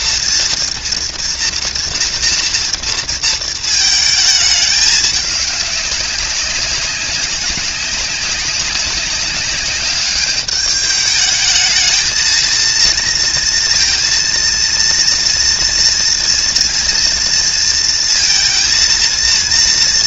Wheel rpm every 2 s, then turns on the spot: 230, 230, 210, 190, 190, 210, 230, 230, 230, 230.
none